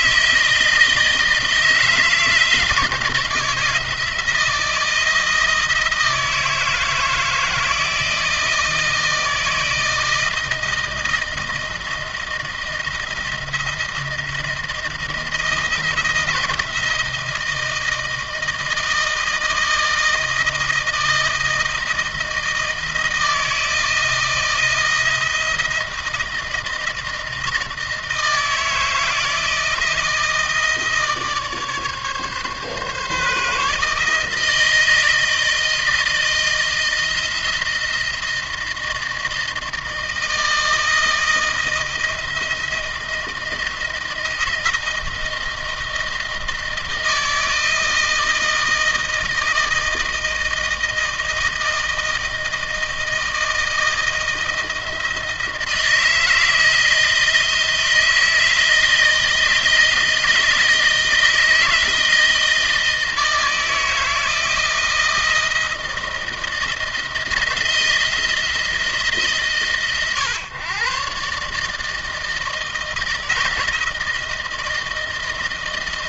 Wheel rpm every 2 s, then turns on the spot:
160, 160, 160, 160, 160, 160, 170, 160, 170, 160, 160, 160, 160, 160, 160, 160, 140, 160, 160, 160, 160, 170, 160, 160, 160, 160, 160, 160, 160, 160, 160, 160, 160, 160, 160, 130, 160, 160.
none